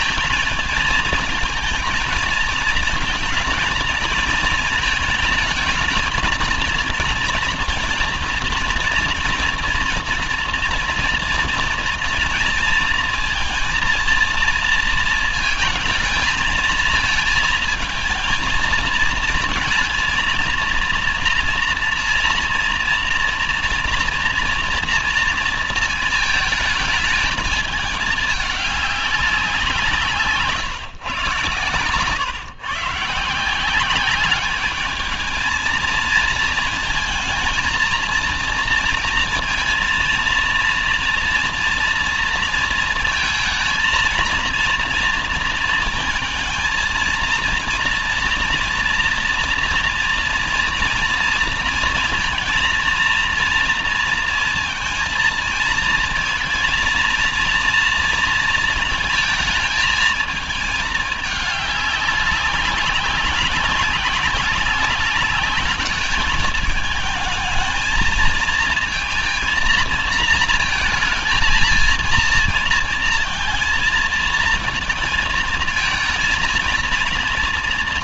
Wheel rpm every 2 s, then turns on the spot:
230, 230, 230, 220, 230, 230, 230, 230, 220, 220, 230, 240, 230, 220, 210, 150, 130, 200, 230, 230, 230, 230, 230, 220, 230, 230, 230, 230, 230, 220, 220, 190, 190, 220, 230, 230, 230, 230, 230.
none